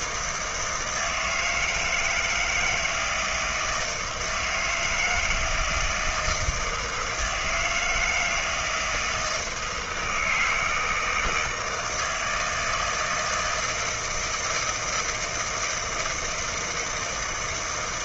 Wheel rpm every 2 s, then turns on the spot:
160, 160, 160, 160, 160, 160, 160, 160, 160.
none